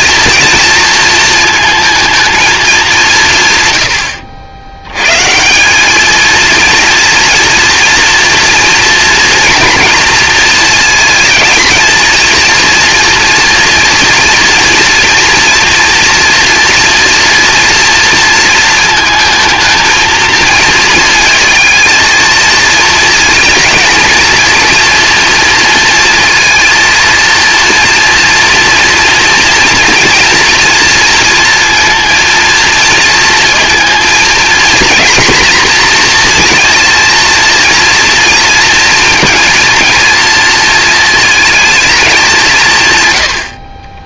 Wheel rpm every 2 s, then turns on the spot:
230, 210, 100, 240, 240, 230, 230, 230, 240, 230, 230, 220, 230, 230, 230, 230, 230, 240, 230, 230, 230, 150.
none